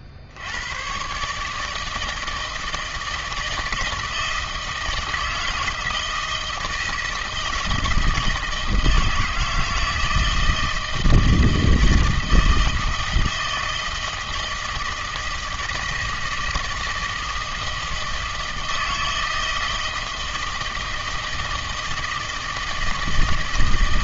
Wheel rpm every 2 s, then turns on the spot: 90, 160, 160, 160, 160, 160, 160, 160, 160, 160, 160, 160.
none